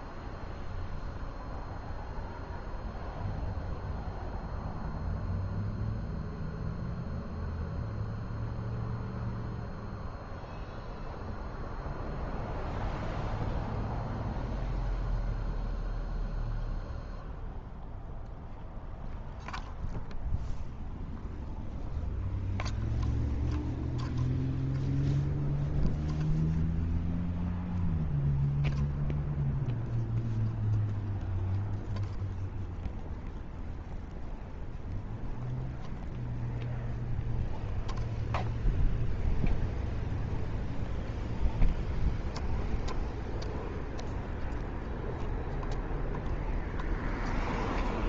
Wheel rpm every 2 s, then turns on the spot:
0, 0, 0, 0, 0, 0, 0, 0, 0, 0, 0, 0, 0, 0, 0, 0, 0, 0, 0, 0, 0, 0, 0, 0.
none